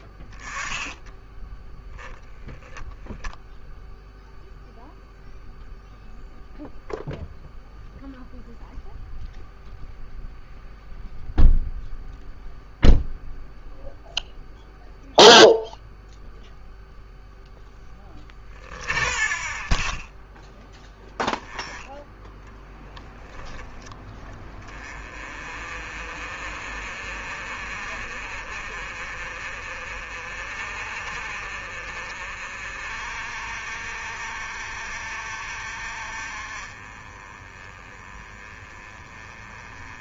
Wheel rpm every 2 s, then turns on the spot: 10, 0, 0, 0, 0, 0, 0, 0, 0, 30, 0, 30, 40, 40, 40, 40, 50, 60, 30, 30.
none